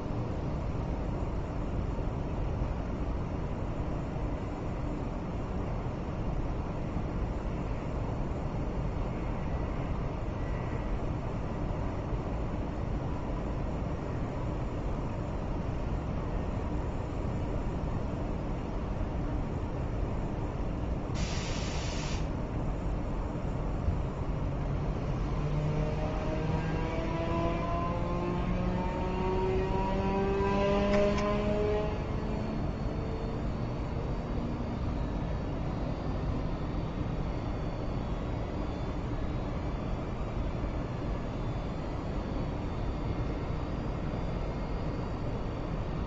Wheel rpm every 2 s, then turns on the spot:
0, 0, 0, 0, 0, 0, 0, 0, 0, 0, 0, 0, 0, 0, 0, 0, 0, 0, 0, 0, 0, 0, 0.
none